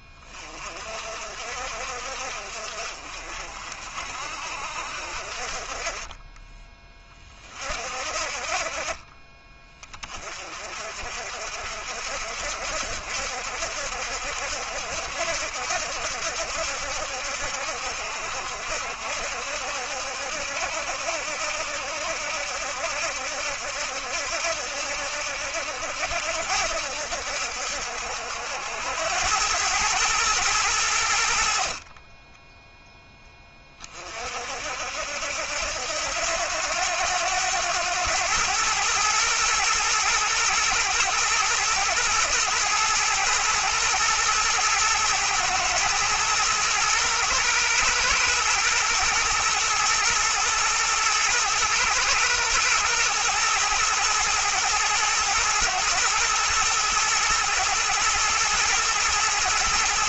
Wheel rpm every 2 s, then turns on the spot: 30, 50, 60, 20, 40, 40, 60, 70, 70, 70, 70, 70, 70, 70, 80, 110, 0, 50, 90, 110, 120, 120, 110, 120, 120, 120, 120, 110, 120, 110.
none